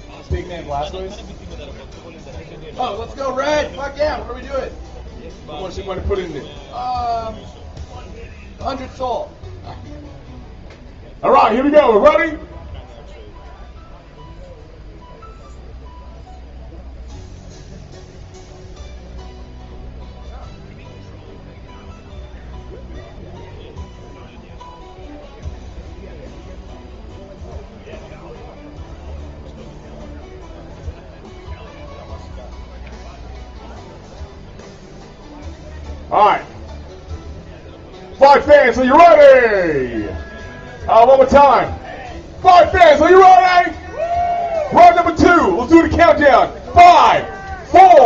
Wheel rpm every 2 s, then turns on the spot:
0, 0, 0, 0, 0, 0, 0, 0, 0, 0, 0, 0, 0, 0, 0, 0, 0, 0, 0, 0, 0, 0, 0, 0.
none